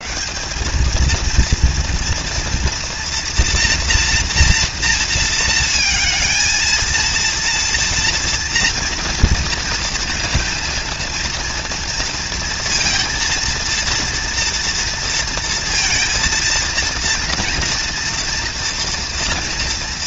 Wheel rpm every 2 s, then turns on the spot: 220, 230, 230, 230, 230, 230, 230, 230, 230, 240.
none